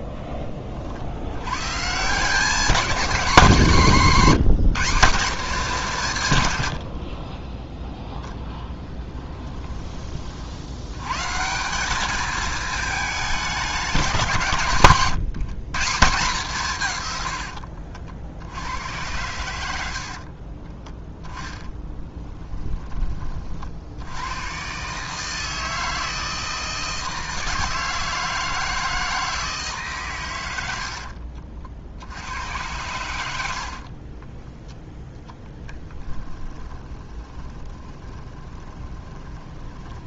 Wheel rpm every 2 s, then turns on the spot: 30, 210, 190, 90, 10, 80, 210, 150, 150, 80, 20, 20, 130, 160, 160, 80, 100, 10, 30, 30.
6-10 20-22 30-32 36-40